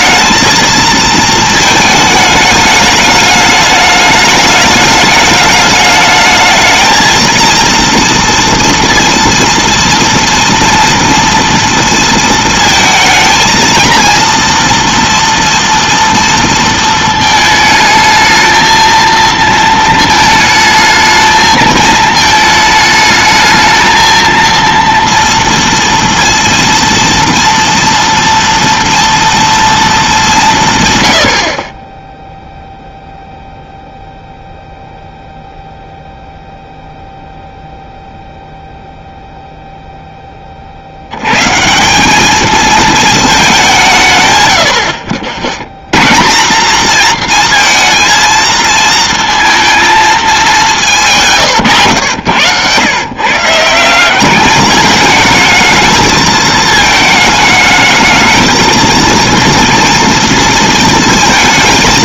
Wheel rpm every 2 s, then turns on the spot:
220, 210, 210, 220, 230, 240, 220, 230, 220, 220, 220, 220, 230, 230, 230, 100, 0, 0, 0, 0, 40, 220, 100, 200, 230, 200, 100, 210, 220, 230, 230.
none